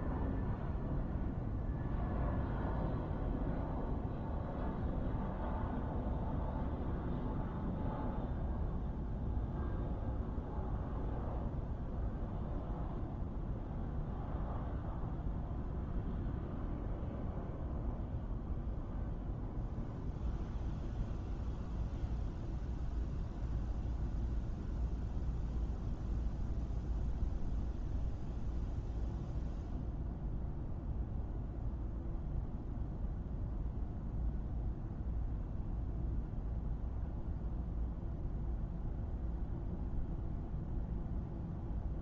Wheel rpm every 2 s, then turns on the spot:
0, 0, 0, 0, 0, 0, 0, 0, 0, 0, 0, 0, 0, 0, 0, 0, 0, 0, 0, 0, 0.
none